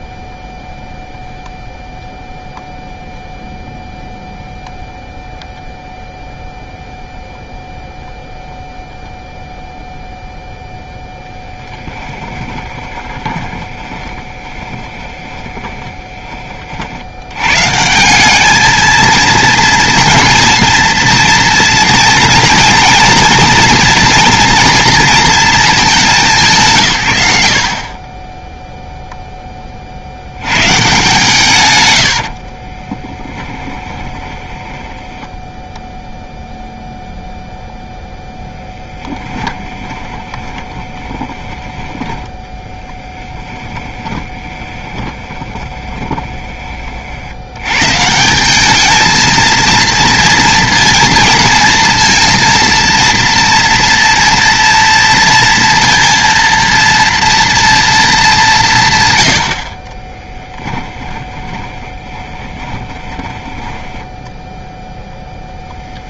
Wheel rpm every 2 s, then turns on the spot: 0, 0, 0, 0, 0, 0, 20, 20, 30, 200, 230, 230, 230, 180, 20, 100, 40, 10, 0, 10, 20, 10, 30, 20, 190, 230, 230, 230, 230, 180, 20, 20, 0.
12-16 32-36 40-42 44-46 60-64